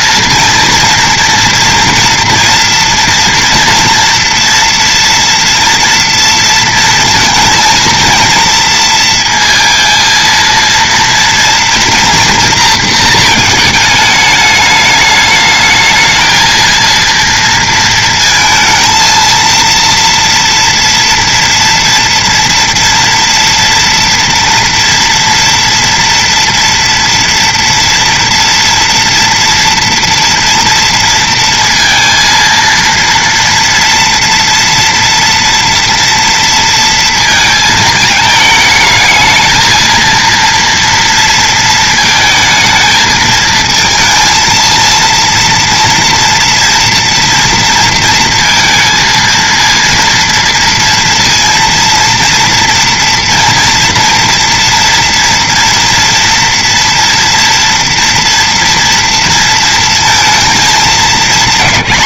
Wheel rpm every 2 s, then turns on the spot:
230, 240, 240, 230, 230, 230, 230, 210, 230, 230, 230, 230, 230, 230, 230, 230, 230, 230, 230, 220, 230, 220, 230, 230, 230, 230, 230, 230, 230, 230, 230.
none